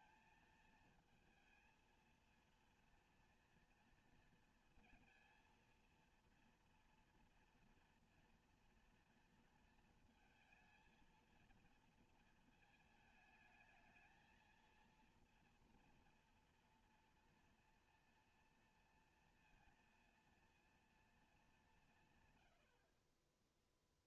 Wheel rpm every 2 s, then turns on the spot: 230, 230, 230, 230, 230, 230, 230, 220, 230, 230, 230, 100.
none